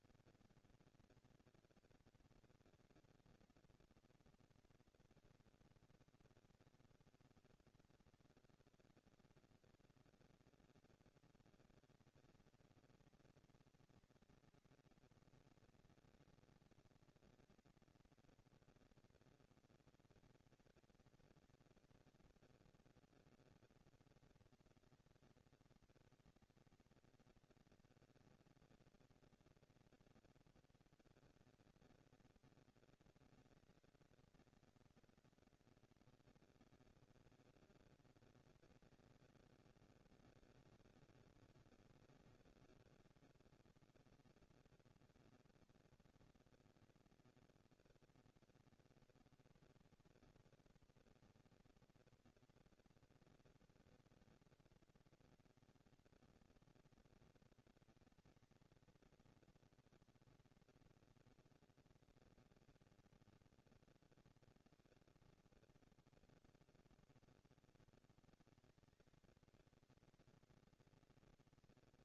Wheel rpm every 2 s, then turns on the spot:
230, 230, 230, 210, 190, 200, 220, 230, 230, 230, 230, 230, 230, 230, 230, 230, 230, 230, 230, 220, 200, 200, 220, 230, 230, 230, 230, 230, 230, 220, 230, 230, 130, 110, 180, 220.
none